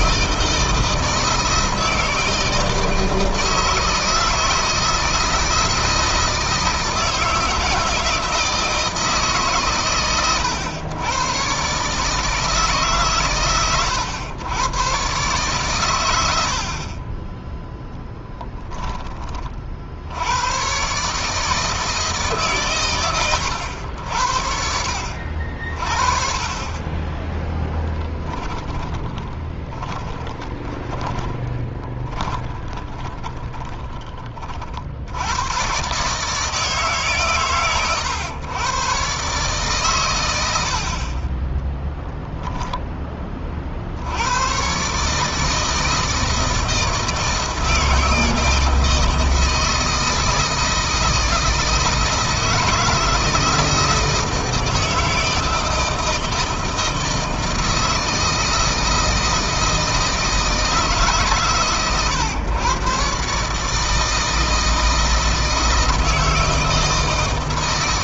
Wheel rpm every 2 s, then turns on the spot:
160, 160, 160, 160, 160, 100, 150, 110, 50, 10, 130, 130, 60, 30, 10, 20, 20, 40, 160, 130, 70, 10, 130, 160, 160, 160, 170, 160, 160, 160, 160, 130, 160, 160.
28-34